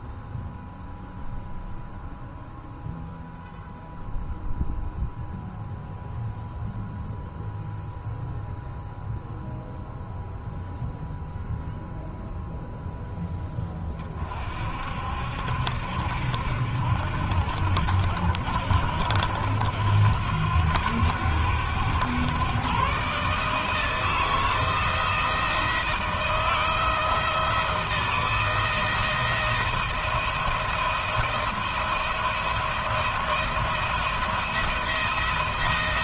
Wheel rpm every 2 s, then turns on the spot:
0, 0, 0, 0, 0, 0, 0, 50, 70, 80, 90, 120, 160, 170, 160, 160, 170, 170.
none